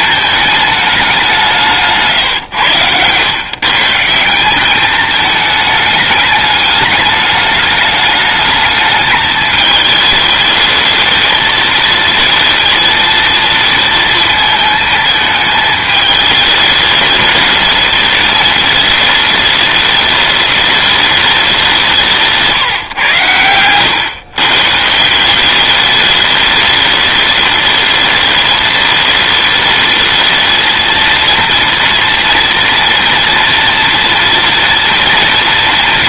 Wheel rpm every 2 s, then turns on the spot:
210, 110, 210, 210, 210, 220, 230, 220, 210, 220, 210, 140, 150, 210, 210, 230, 230, 230.
none